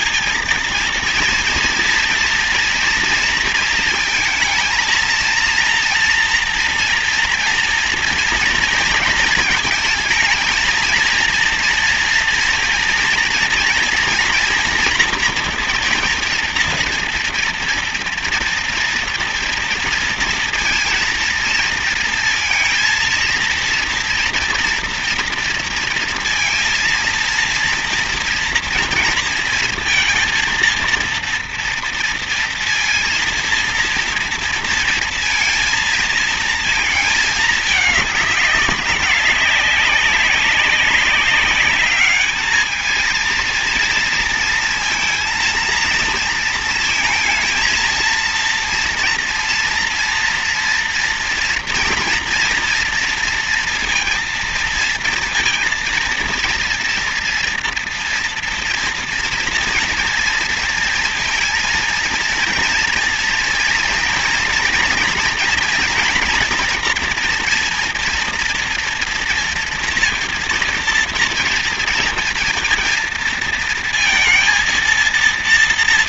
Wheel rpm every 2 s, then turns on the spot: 230, 240, 220, 230, 230, 220, 230, 230, 230, 230, 230, 230, 230, 230, 230, 230, 230, 230, 230, 200, 200, 220, 230, 230, 230, 230, 230, 230, 230, 230, 230, 230, 230, 230, 230, 230, 230, 230.
none